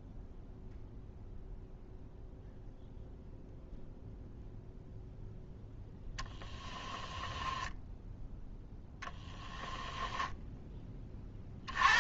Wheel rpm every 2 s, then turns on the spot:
0, 0, 0, 10, 10, 20.
6-10